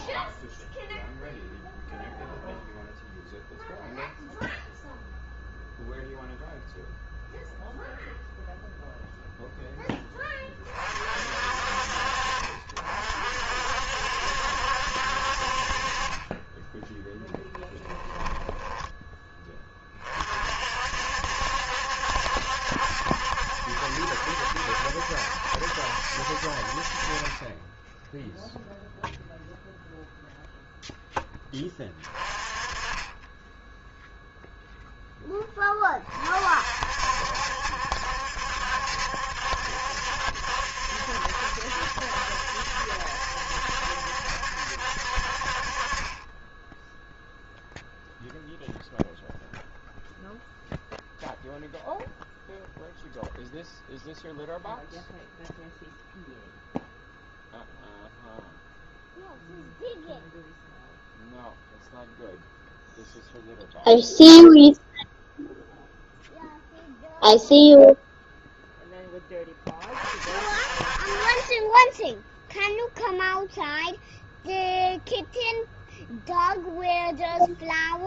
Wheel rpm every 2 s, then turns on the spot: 0, 0, 0, 0, 0, 20, 50, 70, 30, 10, 50, 70, 70, 60, 0, 0, 20, 0, 40, 70, 70, 70, 70, 20, 0, 0, 0, 0, 0, 0, 0, 0, 0, 0, 0, 40, 0, 0, 0.
18-20